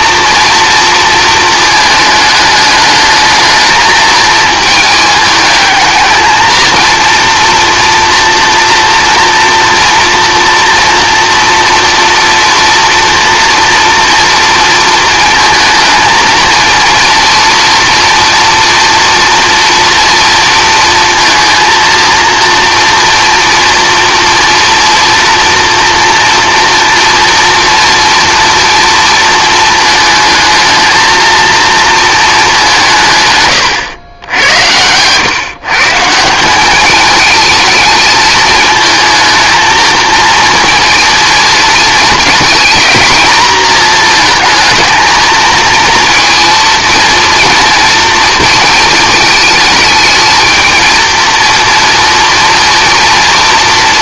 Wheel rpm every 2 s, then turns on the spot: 230, 210, 220, 230, 230, 230, 230, 230, 230, 230, 230, 230, 240, 230, 230, 220, 190, 90, 190, 220, 230, 220, 220, 230, 230, 230, 240.
none